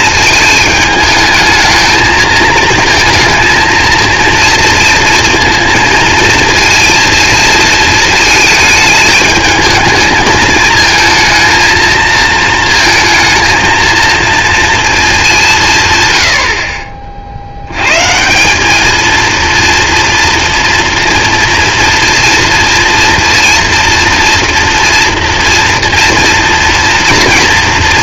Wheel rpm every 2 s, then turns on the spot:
210, 220, 230, 230, 210, 220, 220, 210, 40, 220, 230, 230, 230, 230.
none